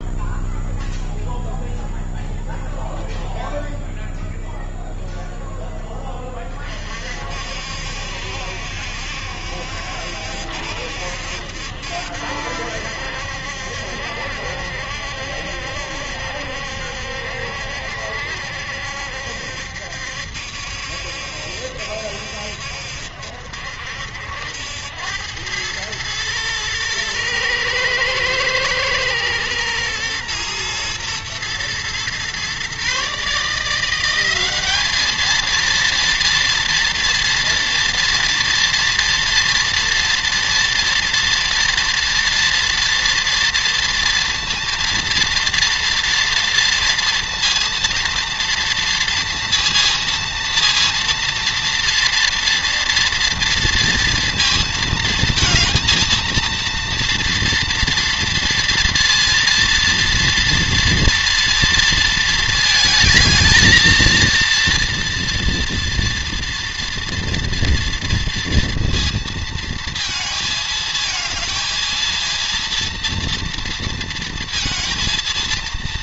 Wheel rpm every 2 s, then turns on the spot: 0, 20, 0, 50, 70, 70, 70, 70, 70, 70, 70, 70, 100, 110, 110, 120, 150, 220, 230, 240, 240, 230, 230, 230, 230, 230, 230, 230, 230, 230, 230, 220, 230, 230, 230, 230, 230, 230.
none